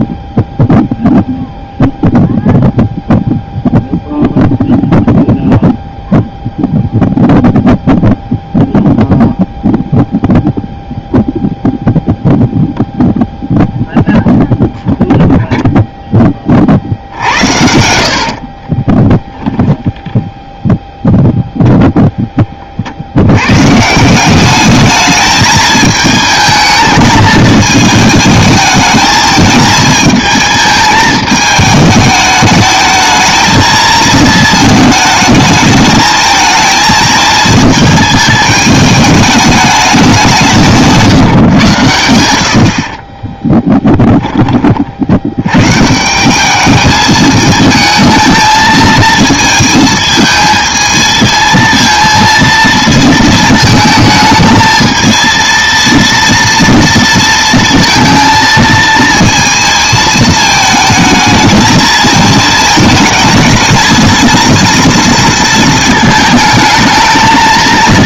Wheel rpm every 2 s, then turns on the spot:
0, 0, 0, 0, 0, 0, 0, 0, 50, 30, 0, 40, 210, 220, 220, 220, 210, 220, 220, 210, 160, 50, 30, 210, 220, 220, 230, 220, 230, 220, 220, 220, 230, 220.
18-20